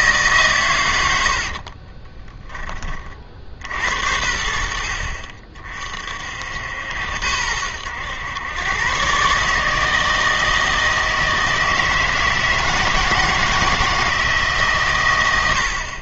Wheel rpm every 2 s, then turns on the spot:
110, 30, 60, 70, 120, 160, 160, 130.
none